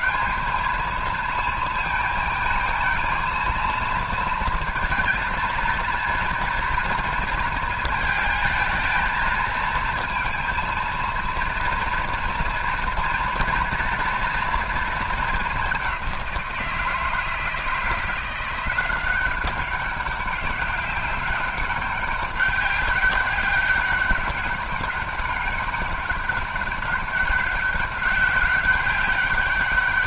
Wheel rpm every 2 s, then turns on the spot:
220, 220, 230, 230, 220, 230, 230, 220, 160, 180, 200, 200, 200, 200, 200.
none